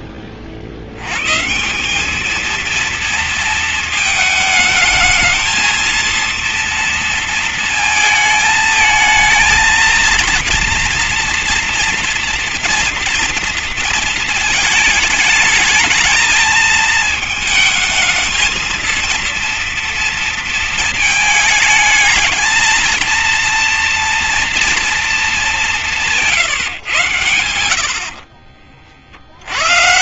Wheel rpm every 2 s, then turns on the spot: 50, 230, 220, 230, 220, 230, 230, 210, 220, 230, 220, 230, 220, 120, 80.
none